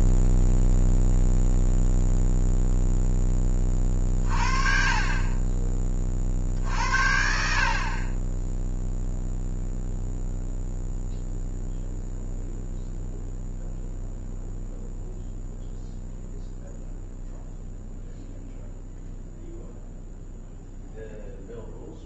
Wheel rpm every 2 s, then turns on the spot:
0, 0, 40, 50, 0, 0, 0, 0, 0, 0, 0.
none